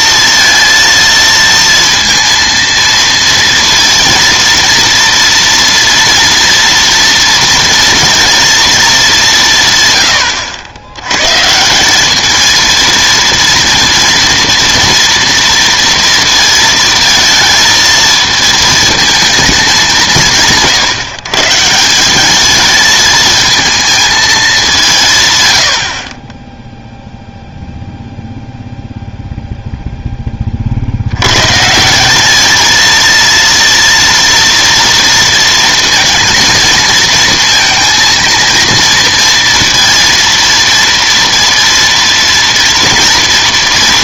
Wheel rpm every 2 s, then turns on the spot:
230, 230, 230, 230, 230, 100, 220, 230, 230, 230, 150, 220, 190, 0, 0, 50, 220, 230, 220, 230, 230, 230.
none